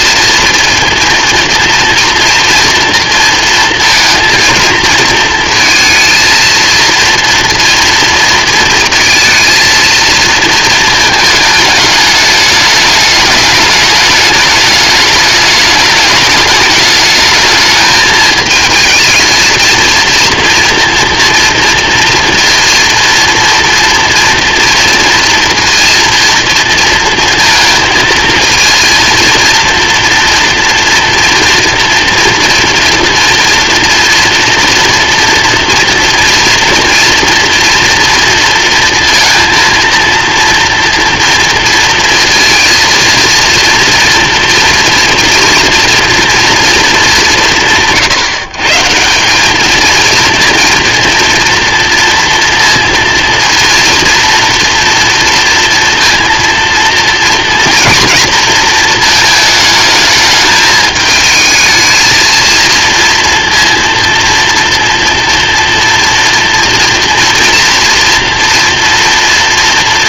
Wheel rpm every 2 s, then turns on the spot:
230, 230, 220, 230, 230, 230, 210, 210, 210, 220, 240, 230, 230, 230, 230, 230, 230, 230, 230, 230, 230, 230, 230, 230, 140, 230, 230, 230, 230, 230, 220, 230, 230, 230, 240.
none